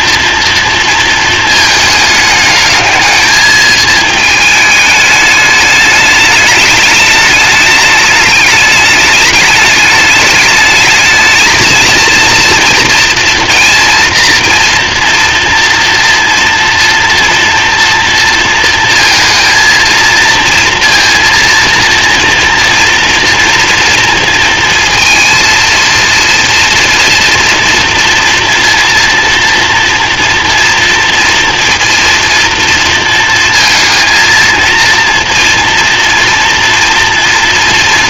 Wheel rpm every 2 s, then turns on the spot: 230, 210, 220, 210, 210, 220, 230, 240, 230, 230, 230, 230, 230, 230, 230, 230, 230, 230, 230.
none